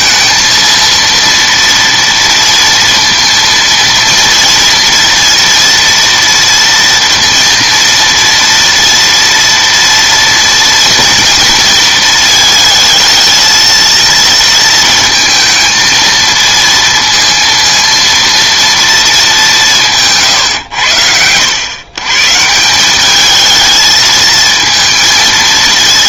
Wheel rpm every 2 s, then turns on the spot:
230, 230, 230, 230, 230, 240, 220, 230, 230, 230, 110, 170, 230.
none